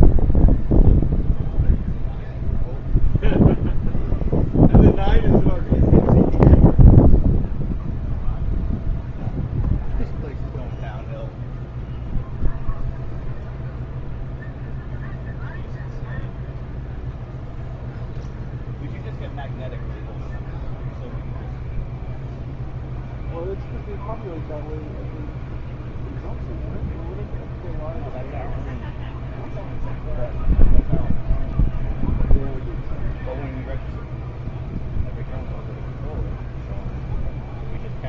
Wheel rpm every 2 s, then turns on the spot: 0, 0, 0, 0, 0, 0, 0, 0, 0, 0, 0, 0, 0, 0, 0, 0, 0, 0, 0.
none